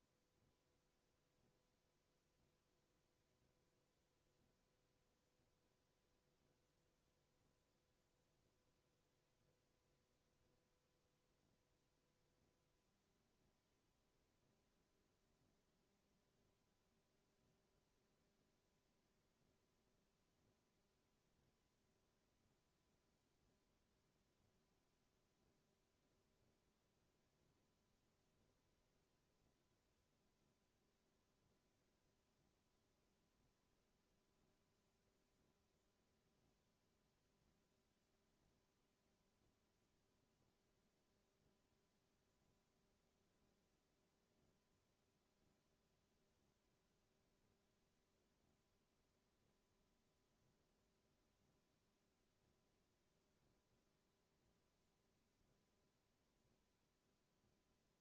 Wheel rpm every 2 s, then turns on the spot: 0, 0, 0, 0, 0, 0, 0, 0, 0, 0, 0, 0, 0, 0, 0, 0, 0, 0, 0, 0, 0, 0, 0, 0, 0, 0, 0, 0, 0.
none